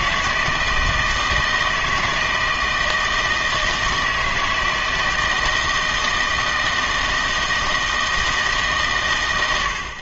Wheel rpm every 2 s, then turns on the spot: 160, 160, 160, 160, 140.
none